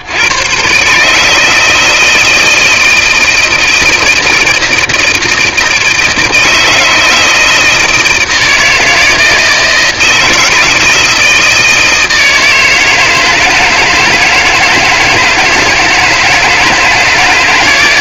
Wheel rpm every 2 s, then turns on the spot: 70, 160, 160, 160, 160, 160, 160, 160, 160.
none